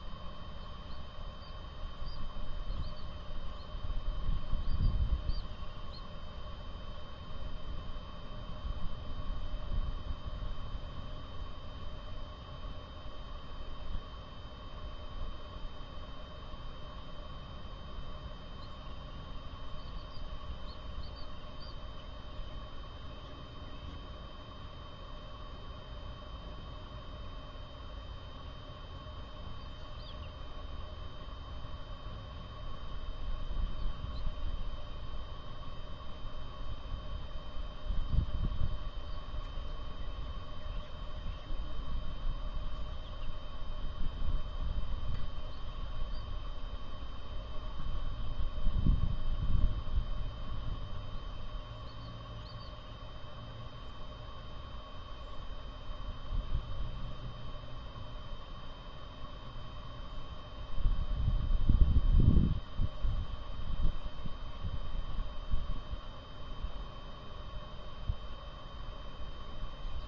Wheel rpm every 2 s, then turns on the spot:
0, 0, 0, 0, 0, 0, 0, 0, 0, 0, 0, 0, 0, 0, 0, 0, 0, 0, 0, 0, 0, 0, 0, 0, 0, 0, 0, 0, 0, 0, 0, 0, 0, 0, 0.
none